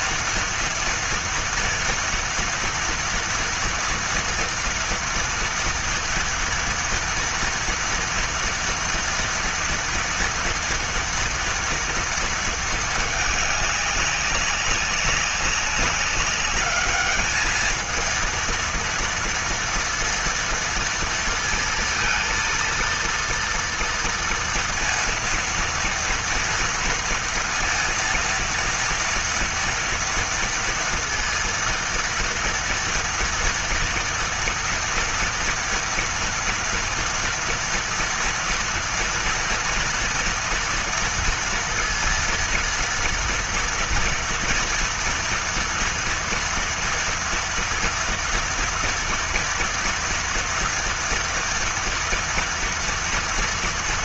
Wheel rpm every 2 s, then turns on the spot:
230, 230, 230, 230, 230, 230, 230, 200, 200, 230, 230, 230, 230, 230, 230, 230, 230, 230, 230, 230, 230, 230, 230, 230, 230, 230, 230.
none